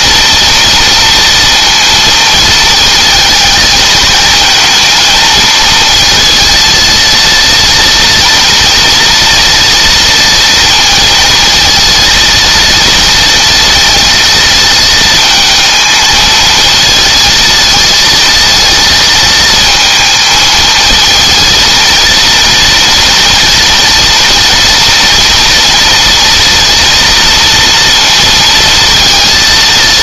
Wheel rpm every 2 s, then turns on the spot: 230, 230, 220, 230, 230, 230, 230, 220, 220, 220, 220, 230, 230, 240, 230.
none